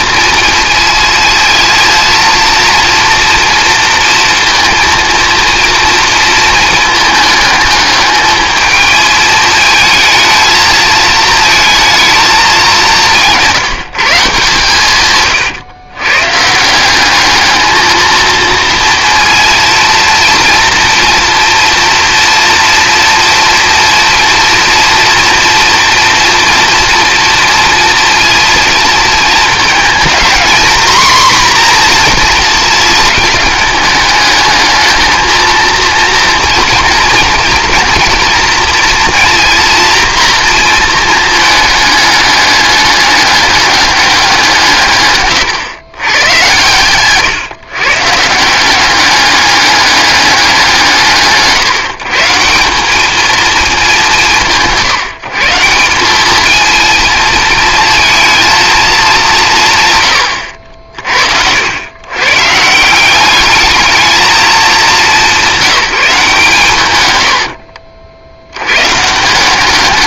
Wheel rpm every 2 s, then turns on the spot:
220, 230, 230, 220, 220, 220, 190, 130, 170, 230, 230, 230, 230, 240, 220, 240, 230, 220, 230, 230, 230, 200, 150, 120, 180, 180, 180, 160, 220, 220, 60, 160, 210, 130, 110.
44-46